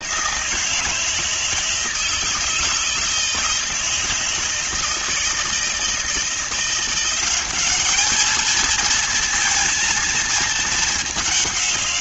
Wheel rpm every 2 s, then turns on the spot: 170, 160, 160, 180, 230, 210.
none